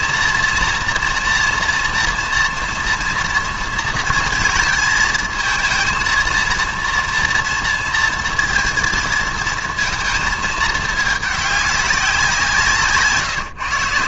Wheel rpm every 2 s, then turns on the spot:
230, 230, 230, 230, 230, 220, 160.
none